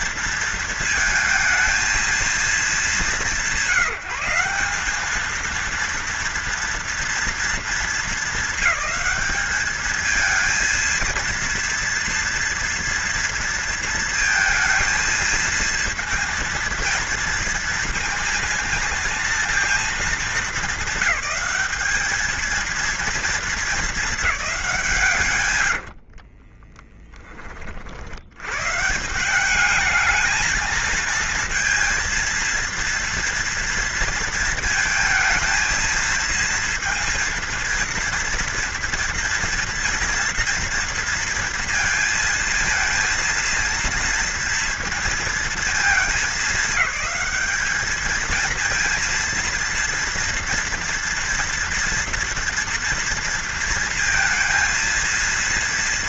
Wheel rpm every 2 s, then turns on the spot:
230, 210, 190, 230, 220, 220, 230, 230, 230, 230, 210, 220, 200, 30, 120, 230, 230, 230, 230, 230, 230, 230, 230, 210, 220, 230, 230, 230.
26-28